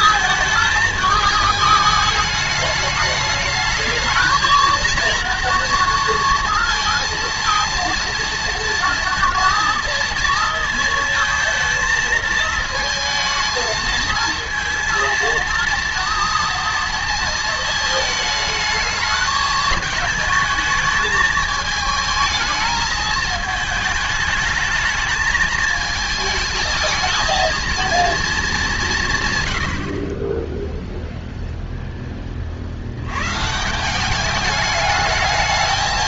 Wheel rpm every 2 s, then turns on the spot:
220, 210, 230, 230, 230, 230, 220, 230, 230, 220, 220, 220, 210, 220, 190, 10, 40, 210.
none